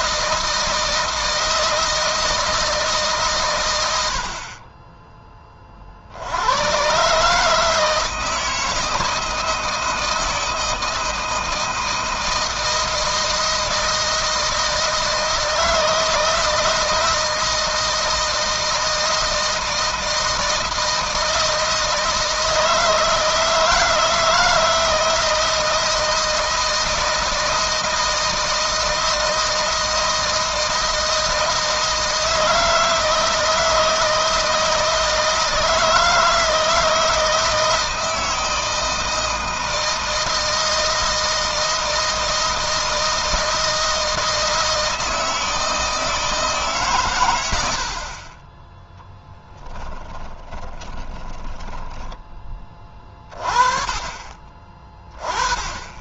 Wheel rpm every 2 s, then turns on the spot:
160, 150, 30, 120, 160, 160, 160, 160, 170, 160, 160, 160, 160, 160, 160, 160, 160, 160, 160, 160, 160, 160, 160, 140, 10, 20, 30, 30.
48-52